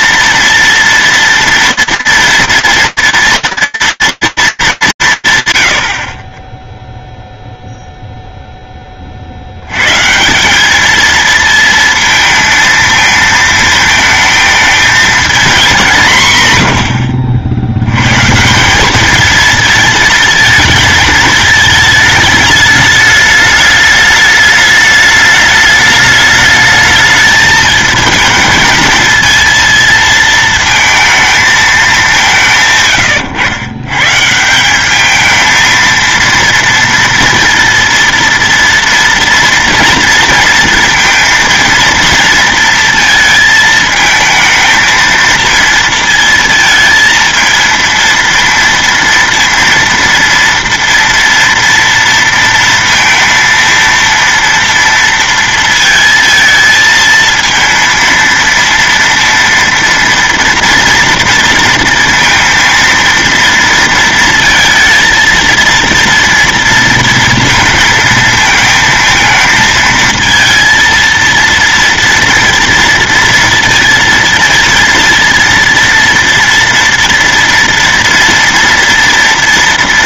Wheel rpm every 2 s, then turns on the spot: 230, 230, 210, 10, 10, 210, 230, 220, 100, 200, 220, 210, 210, 210, 220, 220, 150, 200, 230, 230, 230, 230, 220, 230, 230, 230, 230, 230, 230, 230, 230, 230, 230, 230, 220, 230, 230, 230, 230, 230.
16-18